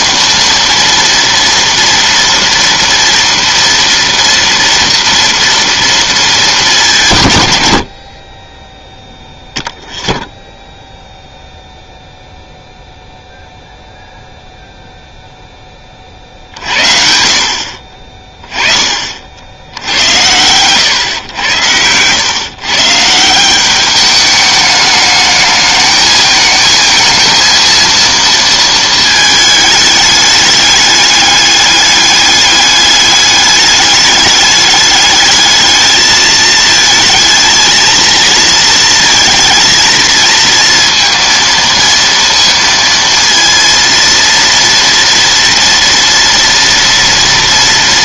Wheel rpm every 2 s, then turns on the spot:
230, 230, 230, 180, 10, 0, 0, 0, 60, 30, 120, 140, 210, 220, 220, 210, 200, 210, 220, 230, 230, 230, 230, 230.
none